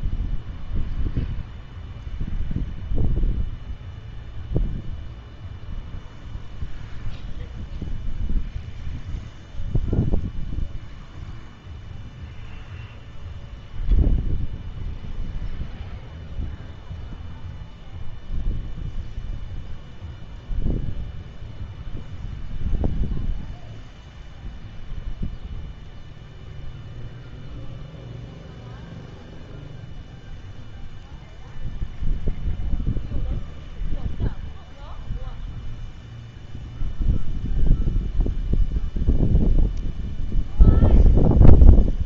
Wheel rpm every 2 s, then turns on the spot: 0, 0, 0, 0, 0, 0, 0, 0, 0, 0, 0, 0, 0, 0, 0, 0, 0, 0, 0, 0, 0.
none